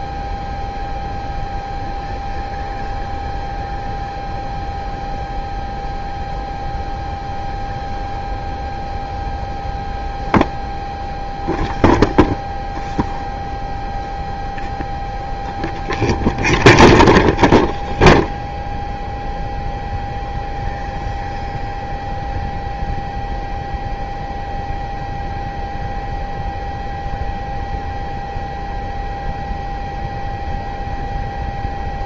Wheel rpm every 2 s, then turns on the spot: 0, 0, 0, 0, 0, 0, 0, 0, 0, 0, 0, 0, 0, 0, 0, 0.
none